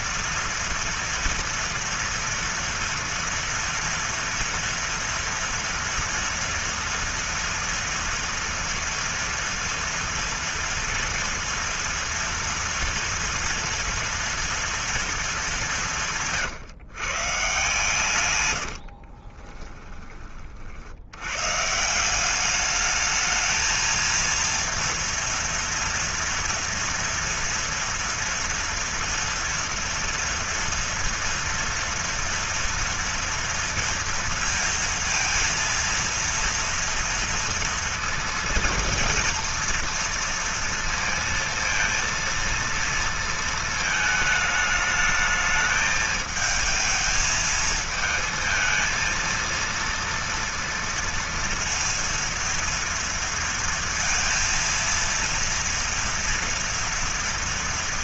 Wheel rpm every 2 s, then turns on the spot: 230, 230, 230, 230, 230, 230, 230, 230, 140, 70, 80, 220, 230, 230, 230, 230, 230, 230, 230, 230, 230, 230, 220, 220, 230, 230, 230, 230, 230.
18-20